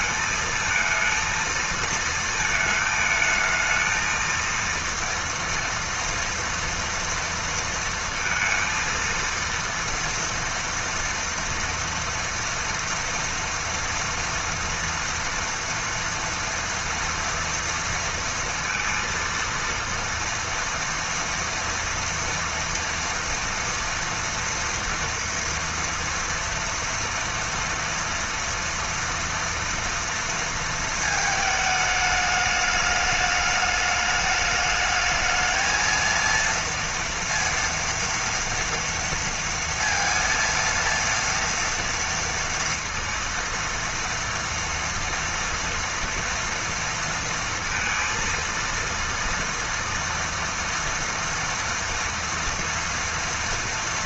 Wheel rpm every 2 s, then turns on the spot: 220, 220, 230, 230, 230, 230, 230, 230, 230, 230, 230, 230, 230, 230, 240, 230, 210, 210, 230, 230, 230, 230, 230, 230, 230, 230, 230.
none